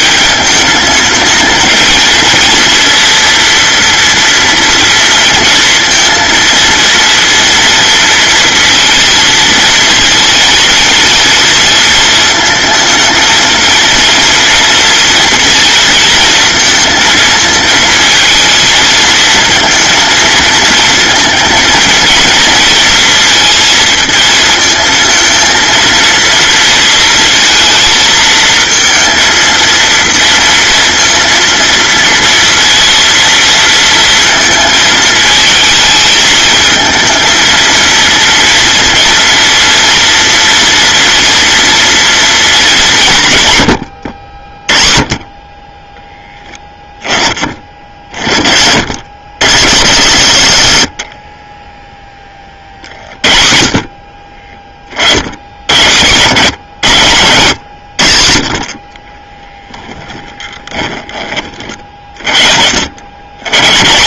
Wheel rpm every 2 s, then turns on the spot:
220, 230, 230, 230, 230, 230, 230, 230, 230, 220, 230, 230, 230, 230, 220, 230, 230, 220, 220, 230, 230, 190, 30, 10, 70, 80, 50, 40, 120, 30, 20, 80.
58-62